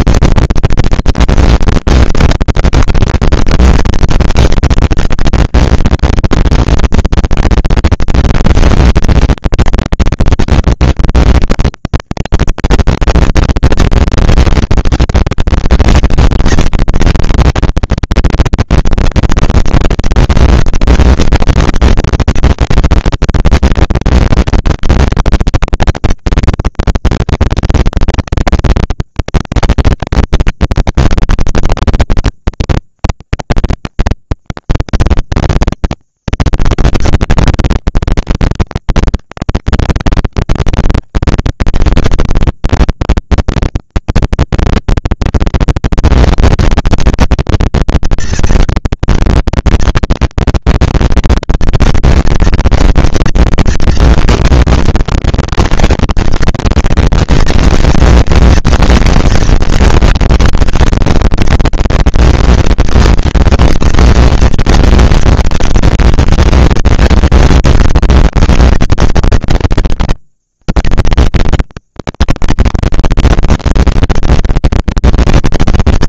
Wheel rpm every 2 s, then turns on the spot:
230, 230, 230, 230, 230, 230, 220, 240, 230, 220, 200, 200, 190, 200, 200, 200, 200, 200, 200, 200, 200, 200, 210, 230, 230, 230, 230, 230, 230, 230, 230, 230, 230, 220, 190, 80, 170, 210.
none